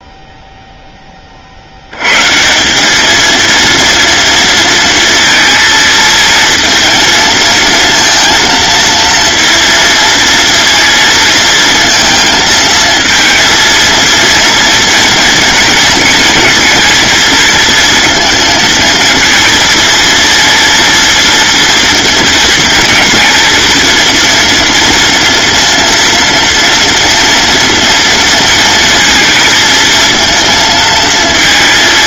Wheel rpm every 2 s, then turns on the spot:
0, 170, 230, 220, 230, 230, 230, 230, 230, 220, 230, 220, 230, 230, 230, 230.
none